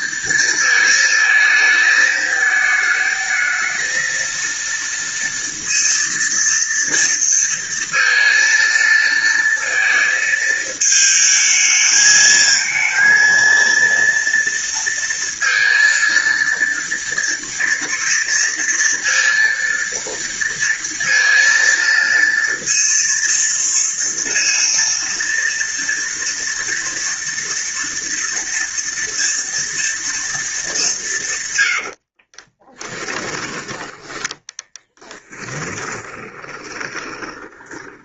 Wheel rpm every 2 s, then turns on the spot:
220, 220, 230, 230, 230, 220, 220, 230, 230, 230, 230, 230, 230, 230, 230, 220, 40, 10, 20.
32-38